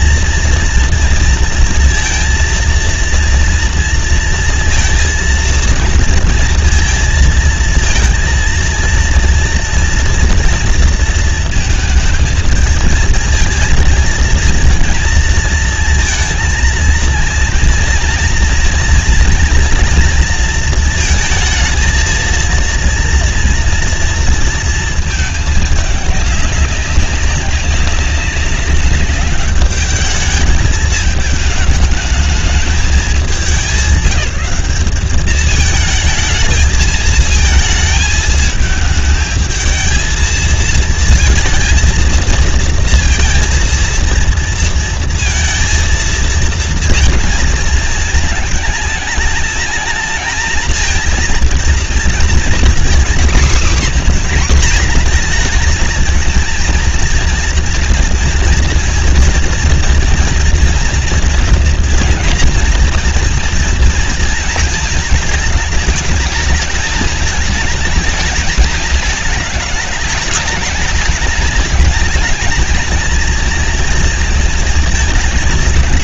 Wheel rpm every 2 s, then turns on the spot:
230, 230, 230, 230, 230, 230, 220, 230, 230, 230, 230, 230, 230, 200, 200, 210, 220, 190, 220, 220, 220, 230, 230, 230, 220, 220, 230, 250, 230, 230, 230, 230, 230, 210, 220, 210, 220, 230.
none